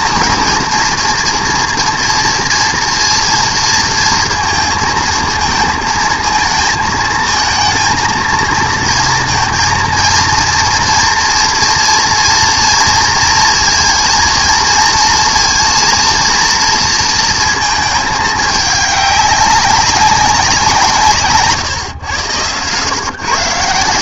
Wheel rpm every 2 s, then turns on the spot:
230, 230, 230, 230, 230, 230, 230, 230, 230, 200, 140, 150.
20-22